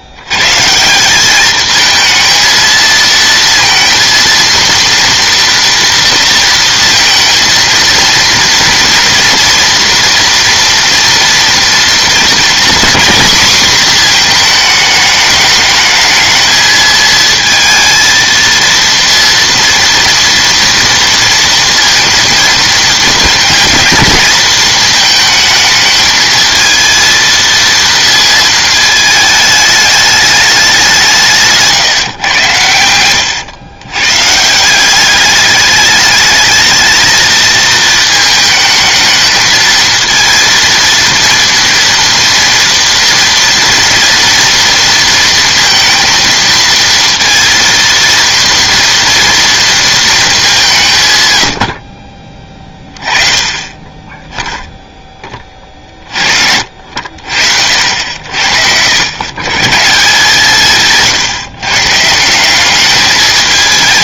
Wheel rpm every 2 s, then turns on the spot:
150, 230, 230, 230, 230, 230, 240, 220, 220, 230, 240, 230, 220, 230, 220, 190, 110, 170, 220, 220, 230, 230, 230, 230, 230, 170, 20, 0, 60, 80, 160, 200.
none